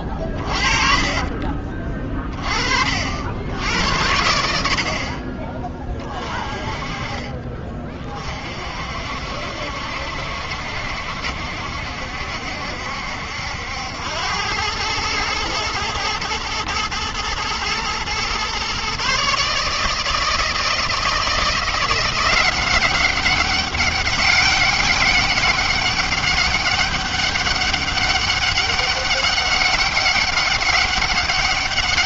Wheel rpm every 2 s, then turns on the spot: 30, 30, 70, 30, 40, 60, 70, 100, 110, 120, 160, 180, 200, 200, 200, 200.
0-2